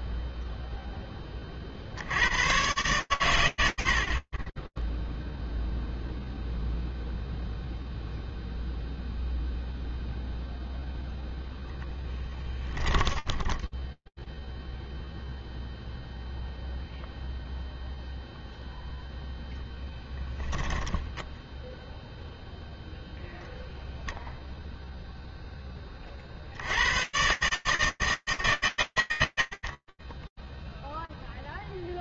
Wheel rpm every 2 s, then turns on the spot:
90, 80, 0, 0, 0, 10, 0, 0, 0, 20, 0, 0, 50, 160, 30, 0.
10-12 18-20